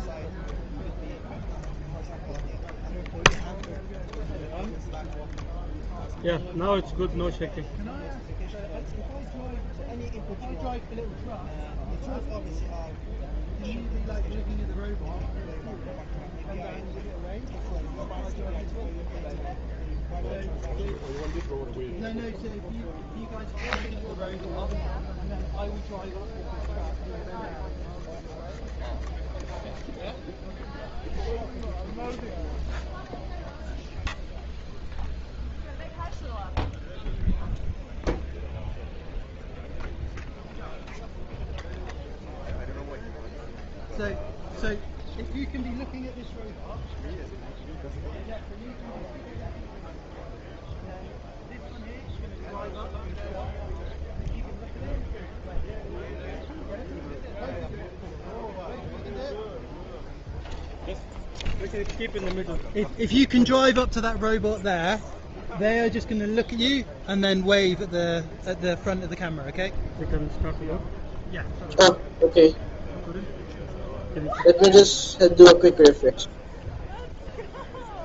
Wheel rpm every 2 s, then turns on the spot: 0, 0, 0, 0, 0, 0, 0, 0, 0, 0, 10, 0, 0, 0, 0, 0, 0, 0, 0, 0, 0, 0, 0, 0, 0, 0, 0, 0, 0, 0, 0, 0, 0, 0, 0, 0, 0, 0, 0.
20-22